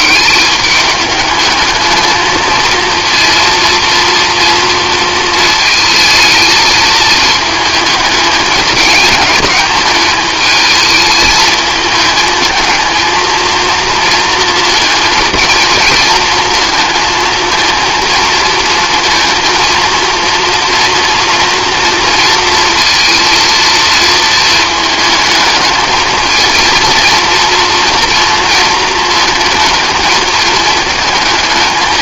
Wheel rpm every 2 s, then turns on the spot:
210, 230, 230, 220, 220, 220, 220, 220, 220, 220, 230, 230, 220, 230, 230, 220.
none